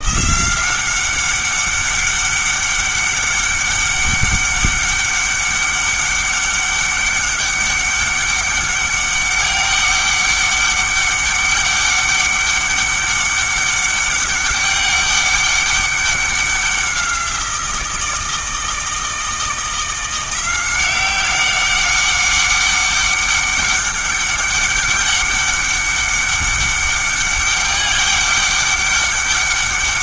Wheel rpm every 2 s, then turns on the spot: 180, 200, 200, 200, 200, 200, 200, 200, 190, 160, 180, 190, 200, 200, 200.
none